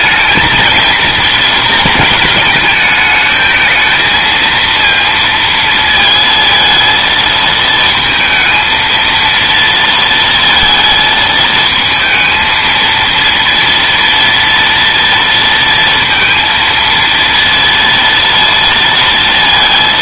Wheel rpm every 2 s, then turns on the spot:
230, 220, 230, 230, 230, 220, 230, 240, 230, 230.
none